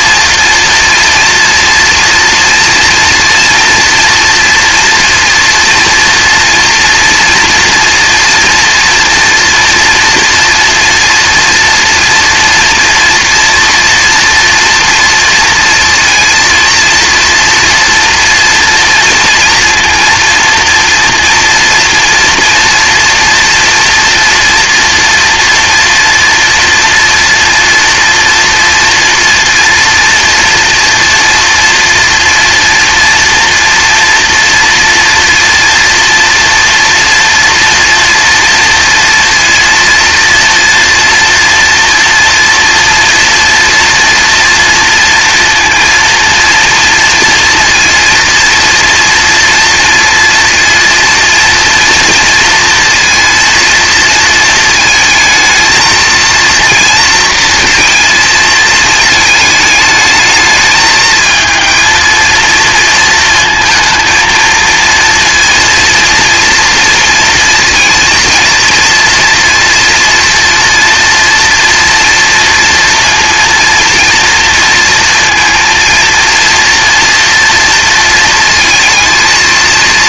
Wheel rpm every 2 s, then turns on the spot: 230, 240, 230, 230, 230, 240, 230, 230, 230, 230, 230, 230, 230, 230, 230, 240, 230, 240, 240, 230, 230, 240, 230, 230, 230, 230, 230, 220, 230, 220, 220, 230, 230, 230, 230, 240, 230, 230, 230, 230.
none